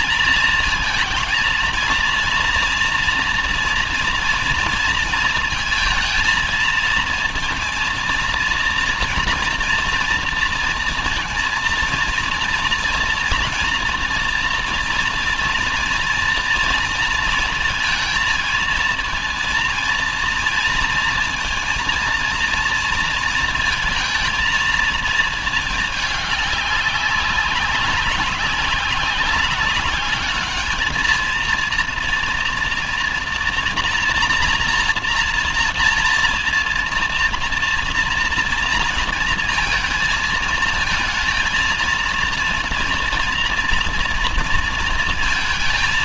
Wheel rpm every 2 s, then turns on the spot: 230, 230, 230, 220, 230, 230, 230, 240, 230, 230, 230, 230, 220, 200, 200, 220, 240, 230, 230, 230, 230, 230, 230.
none